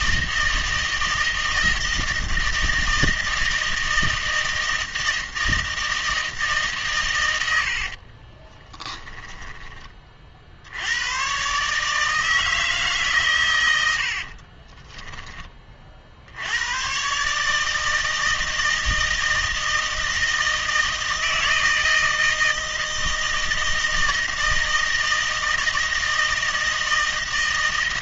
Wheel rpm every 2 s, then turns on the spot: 160, 160, 160, 140, 10, 90, 160, 20, 110, 160, 160, 160, 160, 160.
8-10 14-16